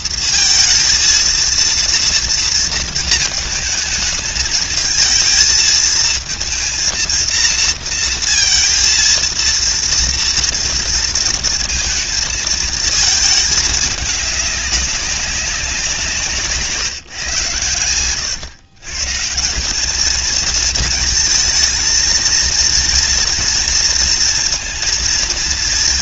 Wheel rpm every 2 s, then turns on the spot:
230, 220, 230, 230, 230, 230, 210, 190, 120, 170, 220, 230, 230.
none